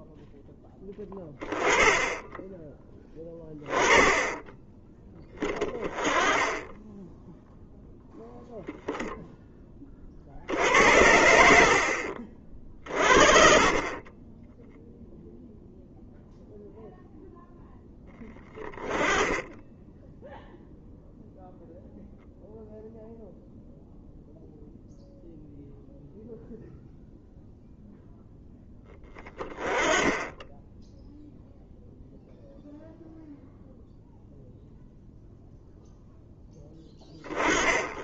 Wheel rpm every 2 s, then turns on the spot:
10, 10, 10, 10, 0, 80, 50, 0, 0, 10, 0, 0, 0, 0, 10, 0, 0, 0, 10.
none